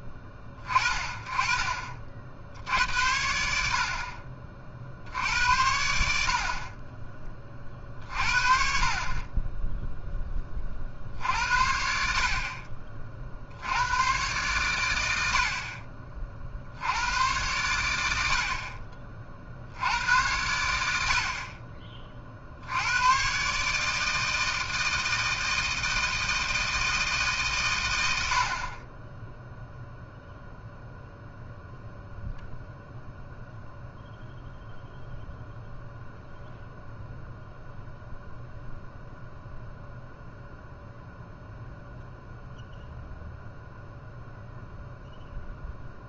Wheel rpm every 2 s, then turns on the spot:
20, 70, 50, 30, 40, 50, 40, 100, 70, 50, 80, 80, 160, 160, 40, 0, 0, 0, 0, 0, 0, 0, 0.
none